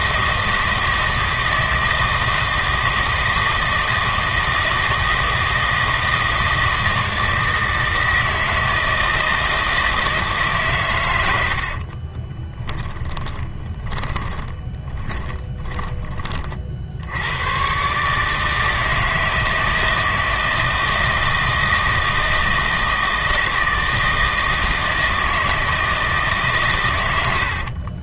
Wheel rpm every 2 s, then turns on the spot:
160, 160, 160, 160, 160, 130, 20, 20, 60, 160, 160, 160, 160, 130.
12-16